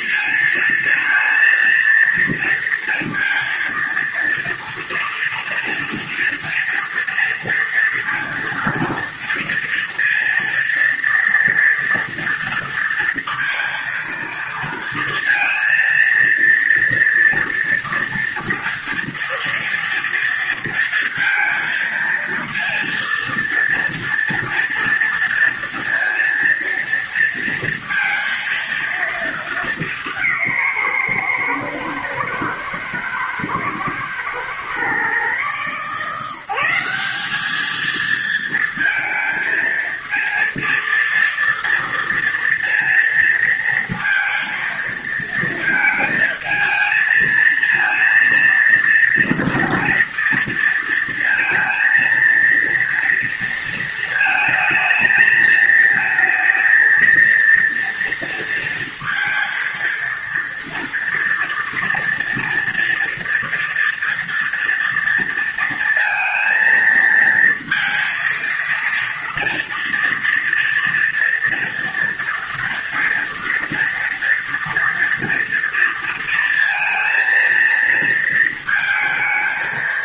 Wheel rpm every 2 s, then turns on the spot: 230, 230, 230, 230, 230, 230, 230, 230, 230, 230, 230, 230, 230, 230, 230, 140, 120, 130, 190, 220, 230, 230, 230, 220, 230, 230, 230, 220, 230, 230, 230, 230, 230, 230, 230, 230, 230, 230, 230, 230.
none